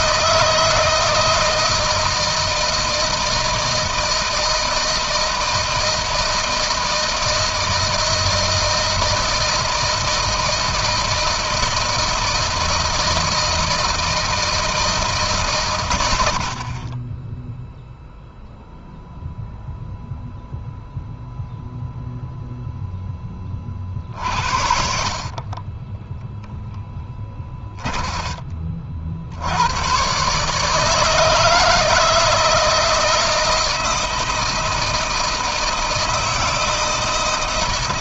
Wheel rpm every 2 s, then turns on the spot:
160, 160, 160, 160, 160, 160, 160, 160, 60, 0, 0, 0, 60, 10, 40, 150, 170, 160, 160.
24-28